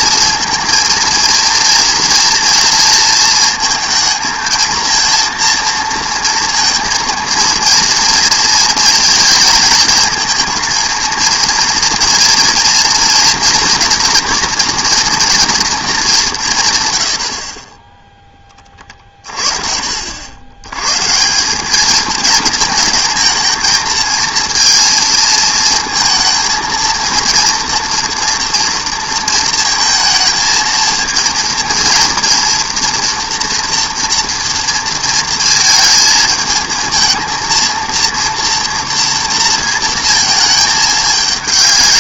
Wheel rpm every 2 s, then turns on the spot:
230, 240, 230, 230, 230, 230, 230, 240, 160, 30, 110, 230, 230, 230, 230, 230, 240, 230, 220, 230, 210.
none